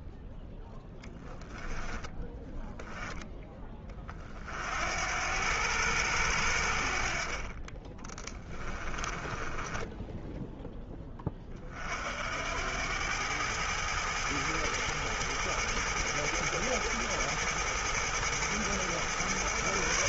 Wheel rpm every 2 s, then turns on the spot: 10, 10, 50, 70, 20, 10, 80, 110, 110, 110.
0-2 8-10